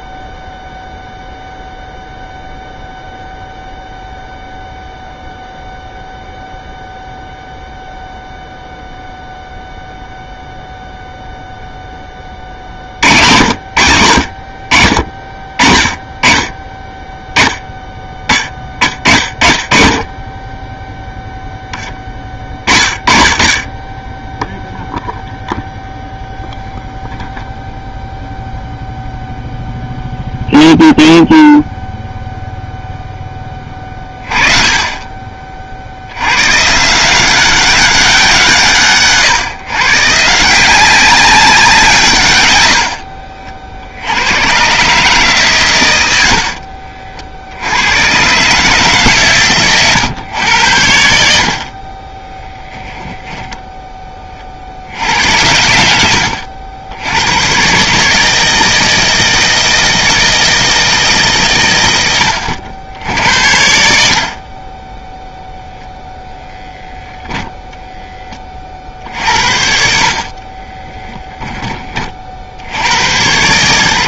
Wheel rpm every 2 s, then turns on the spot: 0, 0, 0, 0, 0, 0, 80, 50, 20, 30, 10, 30, 0, 0, 0, 0, 0, 30, 140, 150, 180, 90, 130, 60, 140, 90, 10, 60, 80, 160, 160, 80, 20, 0, 40, 20, 80.
46-48 52-54 70-72